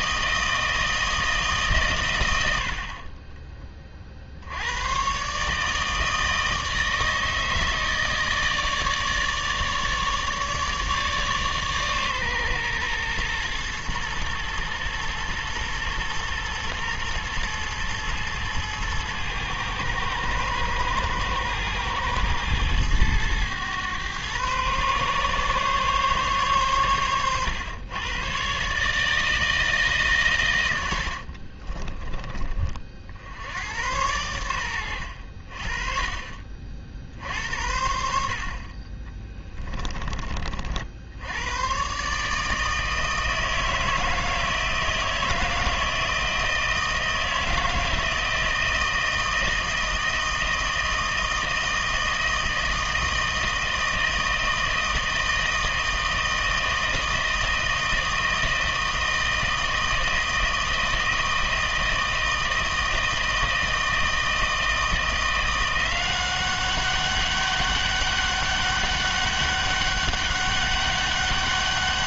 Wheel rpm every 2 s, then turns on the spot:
160, 60, 100, 160, 160, 150, 120, 110, 120, 110, 110, 110, 130, 120, 140, 100, 40, 90, 50, 30, 60, 160, 160, 160, 160, 160, 160, 160, 160, 160, 160, 160, 160, 190, 200, 200.
38-40